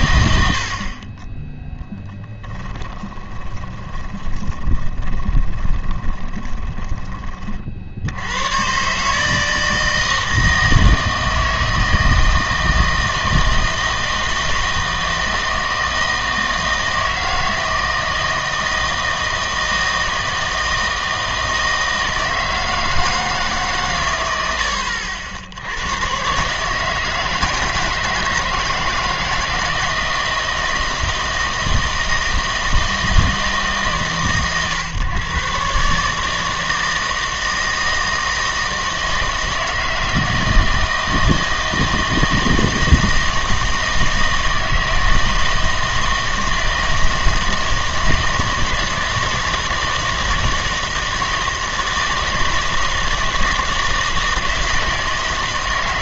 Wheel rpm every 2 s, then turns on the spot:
70, 20, 20, 20, 100, 160, 160, 160, 160, 160, 160, 160, 80, 140, 170, 160, 160, 130, 160, 160, 160, 160, 160, 160, 160, 160, 160, 160.
2-8